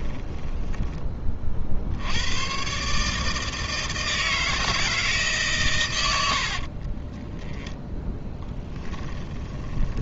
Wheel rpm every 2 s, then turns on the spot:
10, 140, 160, 50, 20.
6-10